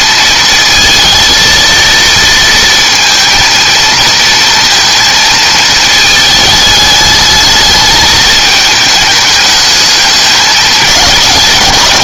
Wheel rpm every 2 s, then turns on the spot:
230, 230, 230, 210, 220, 190.
none